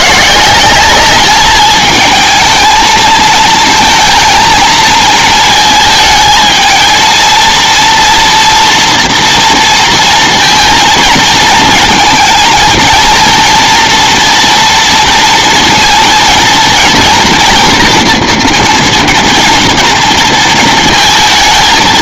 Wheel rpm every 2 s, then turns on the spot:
190, 220, 220, 220, 230, 230, 230, 230, 230, 230, 230.
none